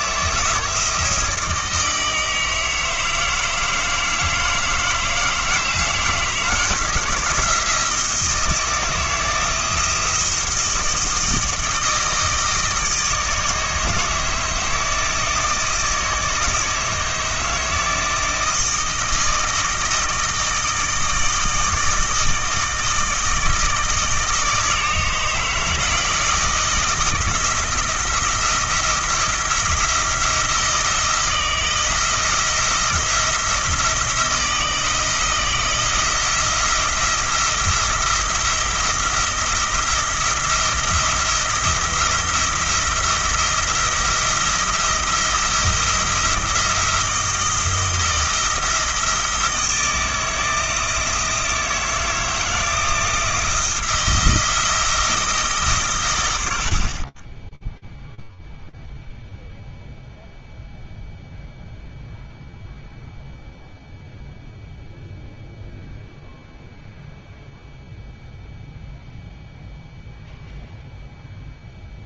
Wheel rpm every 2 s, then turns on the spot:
170, 160, 160, 160, 170, 160, 160, 160, 160, 160, 160, 160, 160, 160, 170, 170, 170, 160, 170, 170, 170, 170, 170, 170, 170, 160, 160, 170, 60, 0, 0, 0, 0, 0, 0, 0.
none